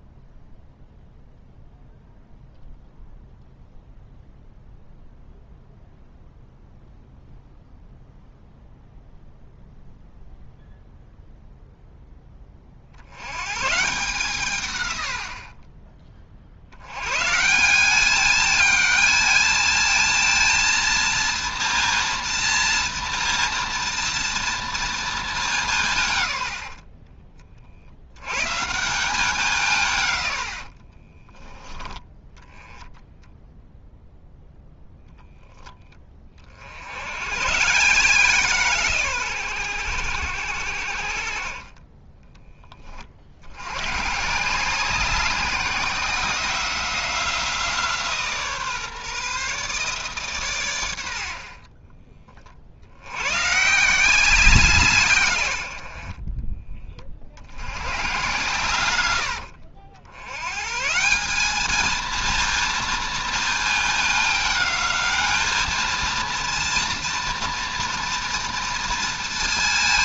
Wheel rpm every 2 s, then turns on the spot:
0, 0, 0, 0, 0, 0, 50, 120, 90, 220, 230, 230, 230, 70, 150, 50, 10, 0, 60, 130, 70, 20, 180, 180, 150, 110, 60, 160, 30, 110, 140, 230, 210, 230, 230.
26-28 30-32